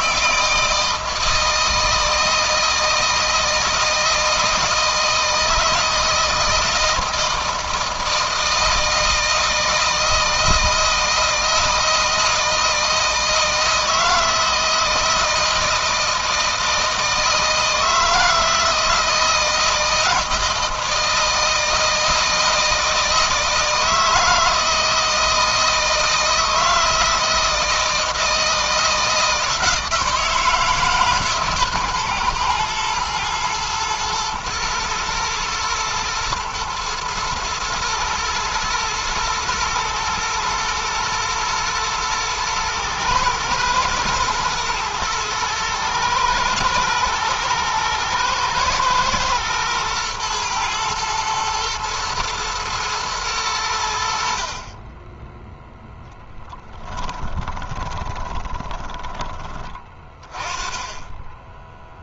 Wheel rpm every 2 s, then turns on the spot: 160, 160, 160, 160, 160, 160, 160, 160, 160, 160, 160, 160, 160, 160, 160, 140, 120, 120, 120, 110, 120, 110, 110, 120, 120, 120, 110, 10, 20, 20, 10.
56-58